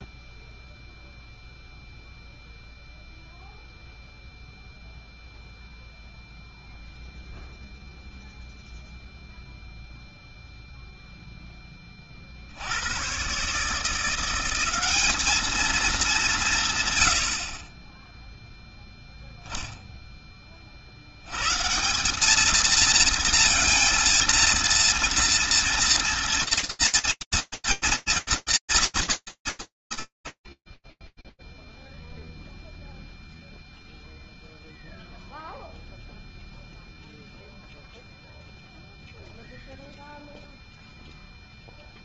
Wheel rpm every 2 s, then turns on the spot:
0, 0, 0, 0, 0, 0, 20, 150, 210, 40, 0, 140, 230, 230, 230, 180, 0, 0, 0, 0, 0.
none